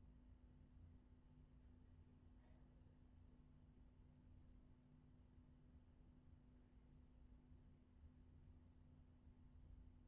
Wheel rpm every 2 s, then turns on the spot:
0, 0, 0, 0, 0.
none